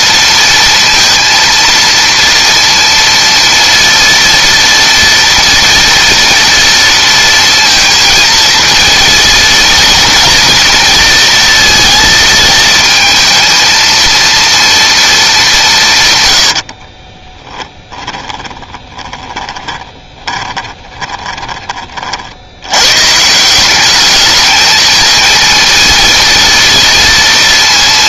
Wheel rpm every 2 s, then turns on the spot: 230, 230, 230, 230, 230, 230, 230, 230, 50, 20, 20, 110, 220, 230.
16-22